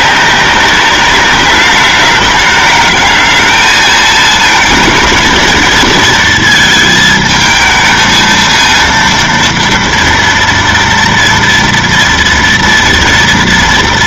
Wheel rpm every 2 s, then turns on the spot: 200, 210, 230, 220, 230, 230, 230.
none